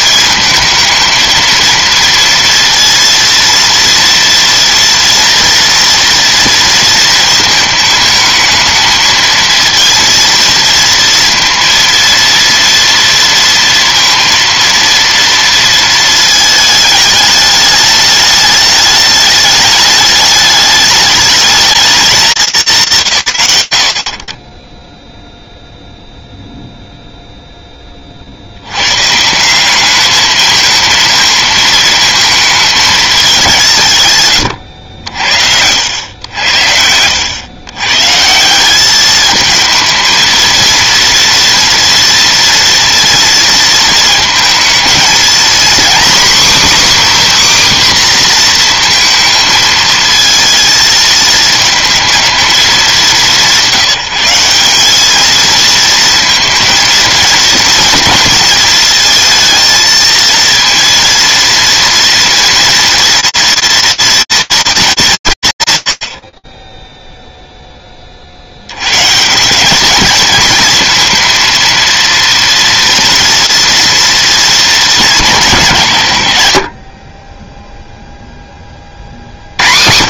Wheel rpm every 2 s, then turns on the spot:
220, 230, 230, 230, 220, 230, 230, 230, 210, 210, 210, 140, 20, 0, 130, 220, 210, 70, 80, 200, 230, 230, 230, 280, 230, 230, 200, 210, 230, 230, 230, 230, 190, 10, 120, 230, 230, 200, 30, 60.
none